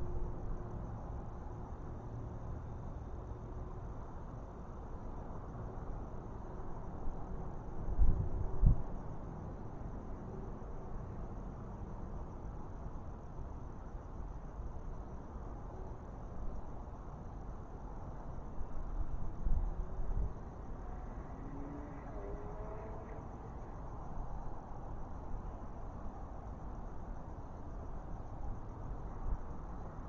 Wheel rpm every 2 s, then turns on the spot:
0, 0, 0, 0, 0, 0, 0, 0, 0, 0, 0, 0, 0, 0, 0.
none